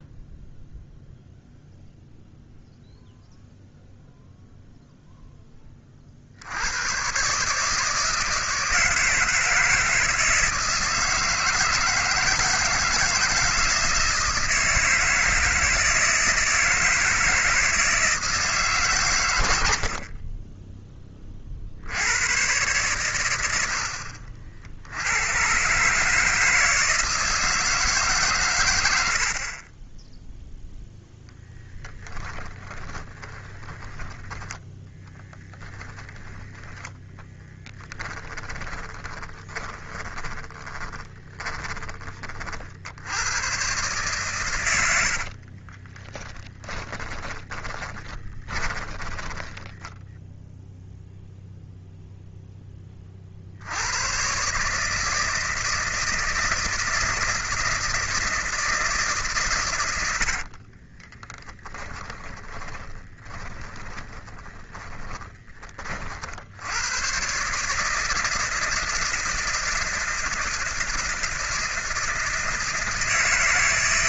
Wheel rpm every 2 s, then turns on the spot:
0, 0, 0, 90, 160, 160, 160, 160, 160, 150, 20, 110, 60, 160, 120, 0, 20, 10, 10, 20, 20, 40, 130, 30, 20, 0, 10, 140, 160, 160, 50, 20, 20, 70, 160, 160, 160.
32-36 38-42 46-50 60-66